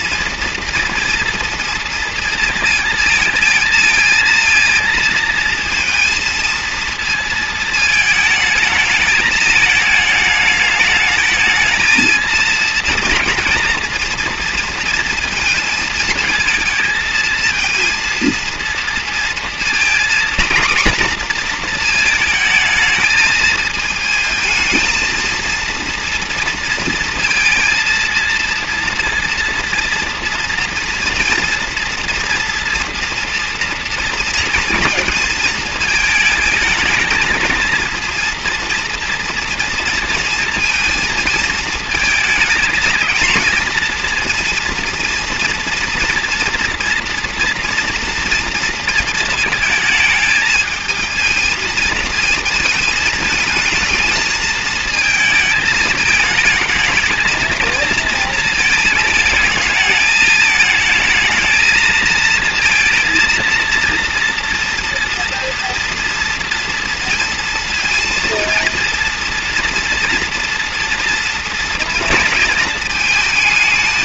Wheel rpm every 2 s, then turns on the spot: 230, 230, 230, 230, 220, 210, 230, 230, 220, 230, 240, 220, 220, 230, 230, 230, 230, 230, 220, 230, 230, 230, 230, 230, 230, 220, 220, 220, 220, 220, 220, 230, 230, 230, 230, 230, 220.
none